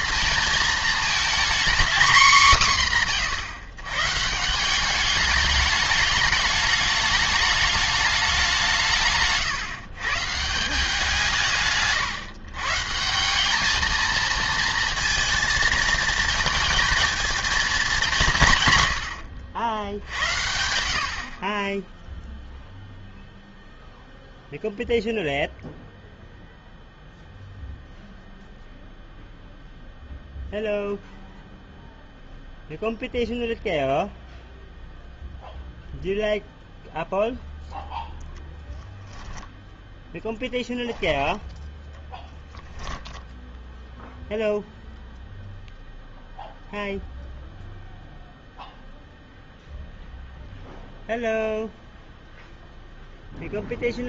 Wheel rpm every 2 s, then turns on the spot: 220, 200, 190, 210, 170, 170, 140, 230, 220, 130, 70, 0, 0, 0, 0, 0, 0, 0, 0, 0, 10, 0, 0, 0, 0, 0, 0.
none